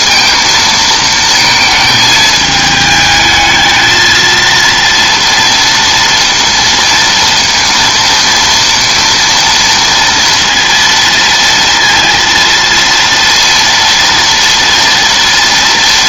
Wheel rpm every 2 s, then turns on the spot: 220, 210, 230, 230, 230, 230, 230, 230.
none